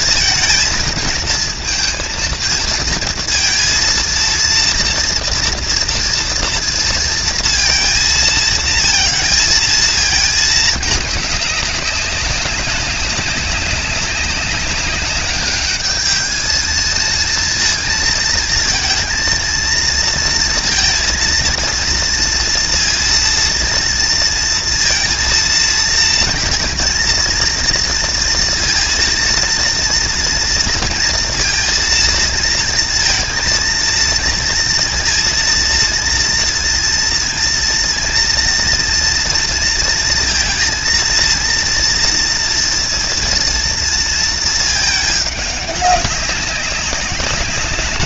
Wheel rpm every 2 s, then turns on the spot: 230, 230, 230, 230, 230, 220, 200, 200, 220, 220, 230, 230, 230, 230, 230, 230, 230, 230, 230, 230, 230, 230, 220, 190.
none